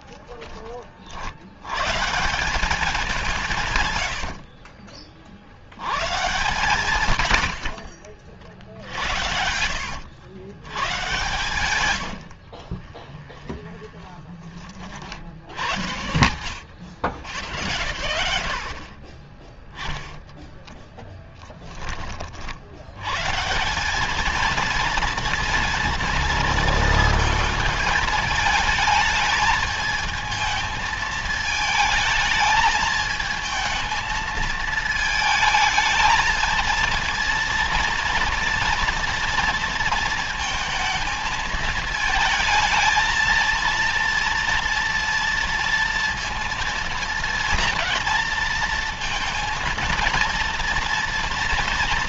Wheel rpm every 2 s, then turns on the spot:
20, 190, 70, 130, 70, 100, 50, 20, 80, 60, 0, 60, 220, 230, 220, 220, 220, 220, 230, 240, 230, 220, 230, 230, 230, 230.
4-6 12-14